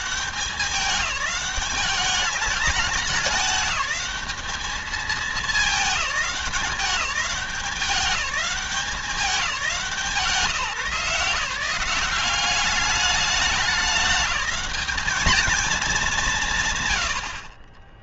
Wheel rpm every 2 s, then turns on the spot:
200, 200, 210, 200, 190, 150, 190, 200, 150.
none